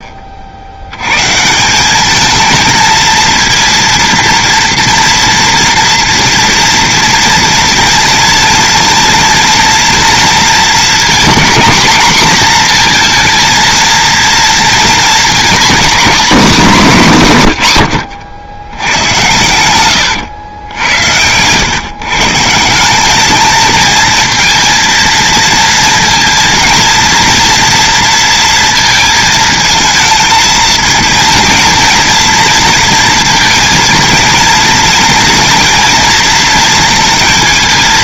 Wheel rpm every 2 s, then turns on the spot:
100, 230, 230, 230, 230, 220, 230, 230, 220, 90, 90, 190, 230, 230, 220, 220, 230, 230, 230.
none